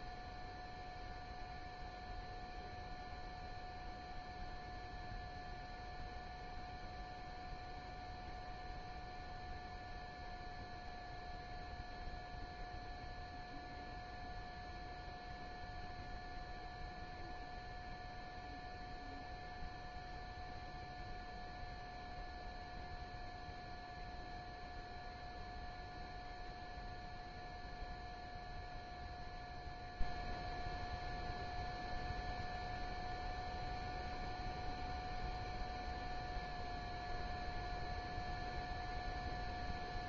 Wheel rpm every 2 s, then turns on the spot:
0, 0, 0, 0, 0, 0, 0, 0, 0, 0, 0, 0, 0, 0, 0, 0, 0, 0, 0, 0.
none